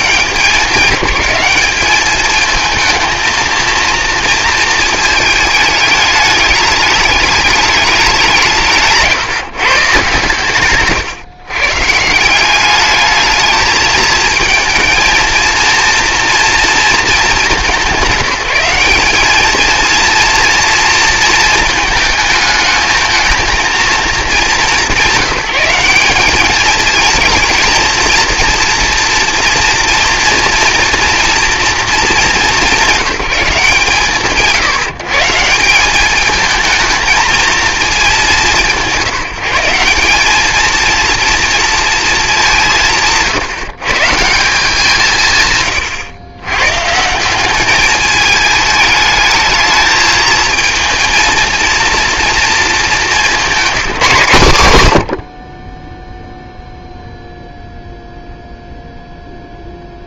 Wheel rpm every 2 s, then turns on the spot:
190, 220, 220, 220, 170, 150, 190, 220, 230, 180, 230, 220, 210, 220, 230, 230, 200, 160, 220, 140, 230, 180, 170, 130, 210, 230, 220, 120, 0, 0.
none